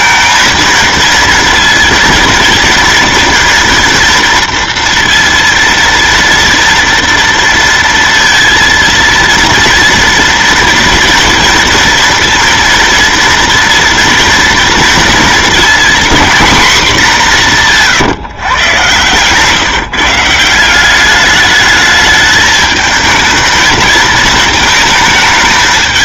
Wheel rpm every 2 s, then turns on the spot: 230, 230, 230, 230, 230, 230, 230, 230, 230, 130, 180, 220, 220.
none